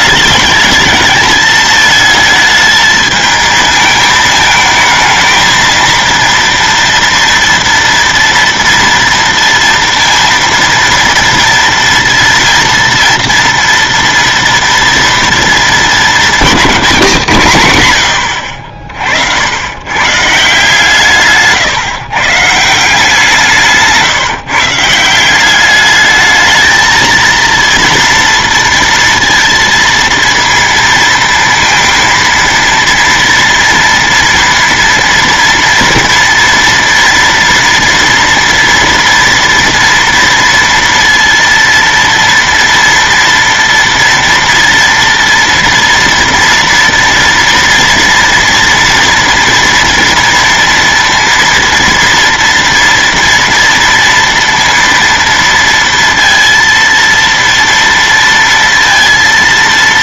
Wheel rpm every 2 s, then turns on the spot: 210, 220, 220, 230, 230, 230, 230, 230, 220, 70, 160, 160, 150, 220, 230, 230, 230, 230, 230, 240, 230, 230, 240, 230, 240, 230, 230, 230, 230, 230.
none